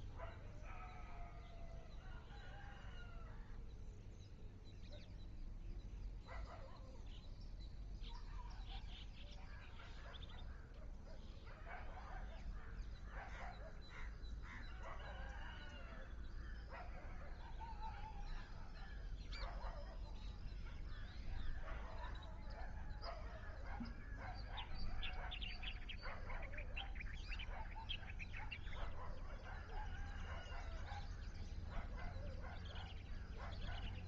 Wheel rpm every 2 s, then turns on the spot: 0, 0, 0, 0, 0, 0, 0, 0, 0, 0, 0, 0, 0, 0, 0, 0, 0.
none